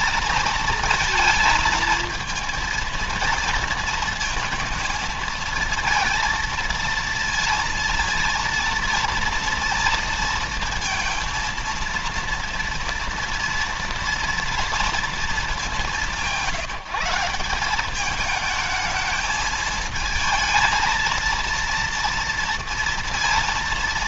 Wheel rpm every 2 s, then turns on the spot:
230, 230, 220, 230, 230, 230, 230, 230, 170, 220, 230, 230.
none